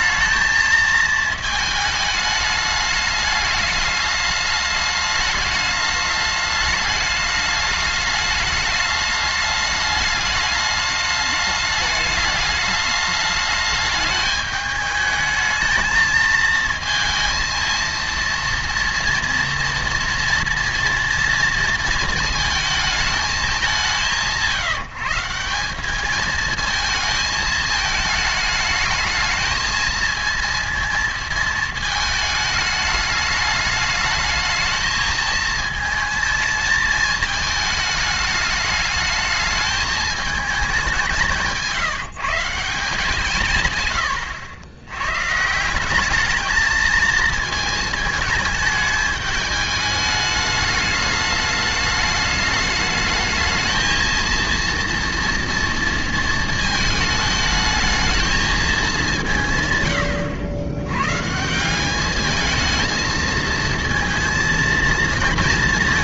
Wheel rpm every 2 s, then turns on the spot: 220, 210, 210, 210, 210, 210, 210, 210, 230, 230, 230, 220, 170, 220, 220, 230, 210, 220, 220, 210, 190, 160, 110, 220, 210, 210, 210, 230, 220, 200, 110, 220, 230.
none